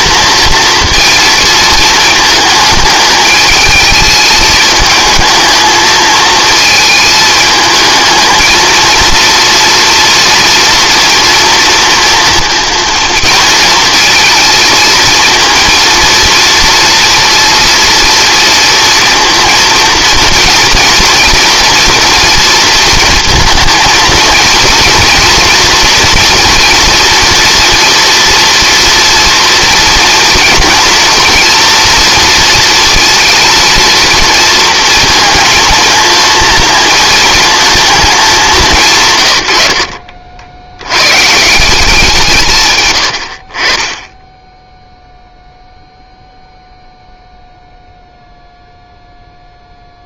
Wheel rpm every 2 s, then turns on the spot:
230, 220, 220, 220, 220, 230, 230, 230, 230, 230, 230, 230, 230, 230, 240, 230, 230, 230, 230, 190, 90, 140, 10, 0, 0.
none